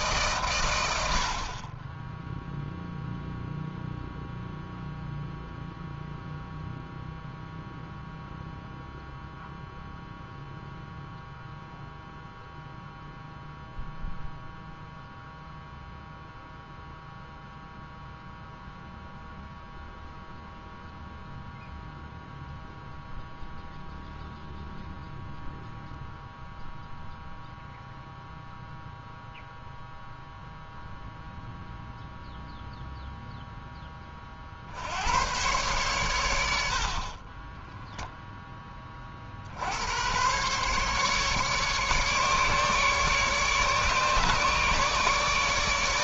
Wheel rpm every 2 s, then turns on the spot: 80, 0, 0, 0, 0, 0, 0, 0, 0, 0, 0, 0, 0, 0, 0, 0, 0, 70, 70, 10, 130, 150, 150.
none